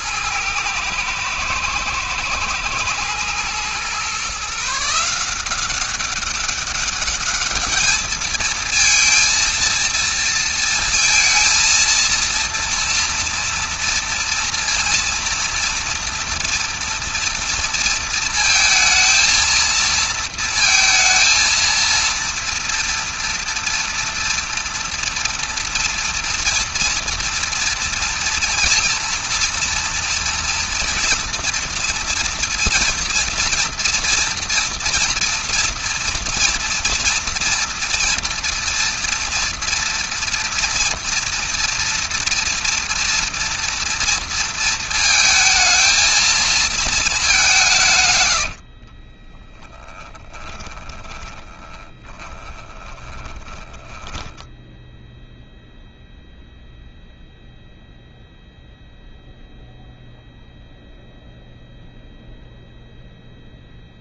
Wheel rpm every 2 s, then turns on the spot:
110, 110, 150, 200, 220, 230, 230, 230, 240, 230, 230, 230, 230, 230, 230, 230, 240, 230, 230, 230, 230, 240, 230, 220, 70, 20, 10, 0, 0, 0, 0, 0.
48-54